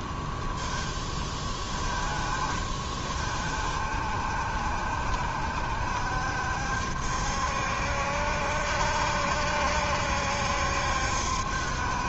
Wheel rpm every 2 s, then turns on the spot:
10, 40, 70, 70, 70, 70.
none